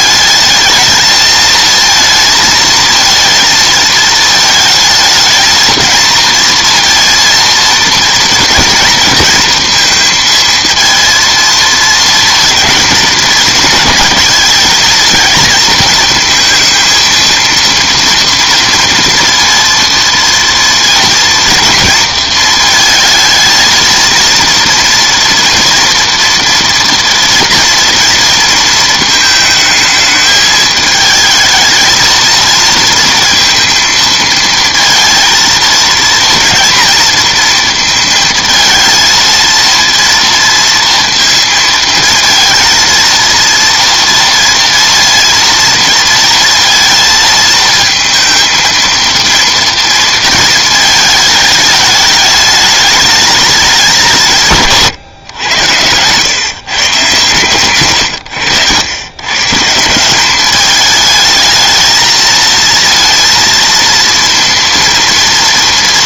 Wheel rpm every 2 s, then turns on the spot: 220, 230, 220, 230, 230, 230, 230, 220, 230, 230, 230, 230, 240, 230, 230, 220, 230, 230, 230, 220, 230, 230, 230, 230, 230, 220, 210, 150, 130, 100, 210, 220, 240.
none